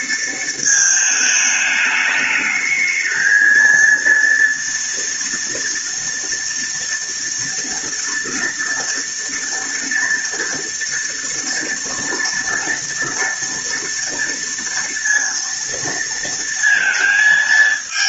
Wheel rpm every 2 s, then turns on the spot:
220, 210, 240, 230, 240, 230, 230, 230, 230.
none